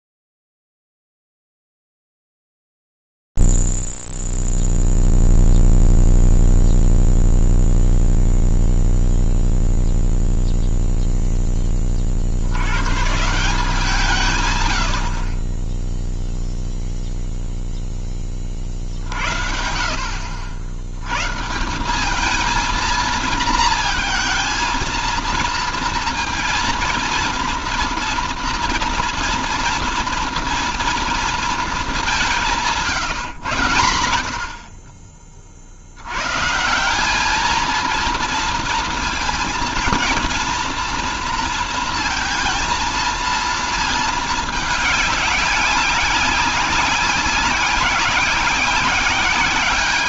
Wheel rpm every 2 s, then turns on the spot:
0, 0, 0, 0, 0, 0, 60, 140, 0, 30, 80, 220, 230, 230, 240, 230, 180, 50, 170, 230, 230, 230, 200, 190, 190.
none